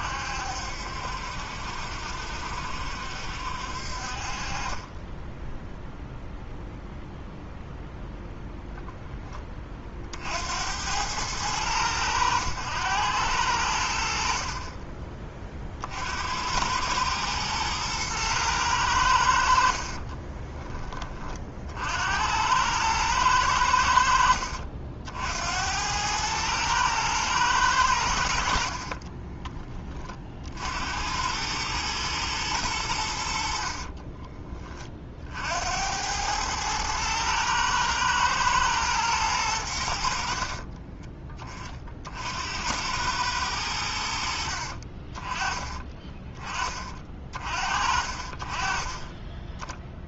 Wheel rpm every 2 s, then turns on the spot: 70, 70, 30, 0, 0, 70, 100, 40, 90, 110, 30, 90, 70, 110, 60, 60, 110, 30, 110, 110, 40, 80, 60, 20, 30.
20-22 28-30 40-42